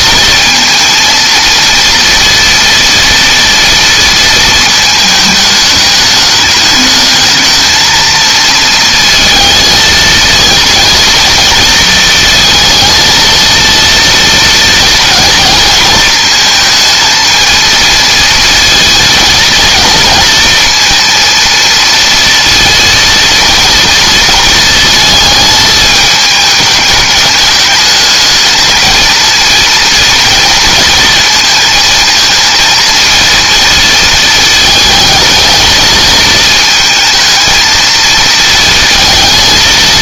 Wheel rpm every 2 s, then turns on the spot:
220, 230, 220, 210, 230, 230, 220, 230, 220, 230, 230, 230, 220, 210, 220, 230, 230, 220, 220, 220.
none